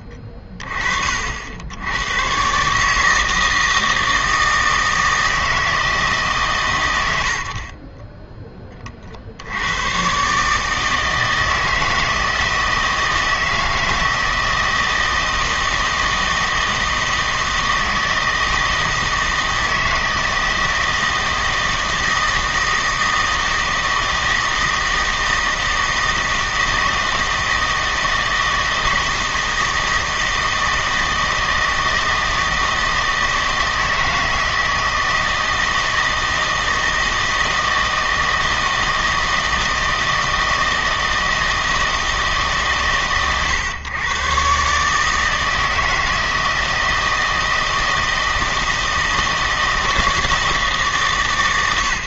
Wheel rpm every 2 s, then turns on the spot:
30, 140, 160, 120, 20, 150, 160, 160, 160, 160, 160, 160, 160, 160, 160, 160, 160, 160, 160, 160, 160, 140, 140, 160, 160, 160.
none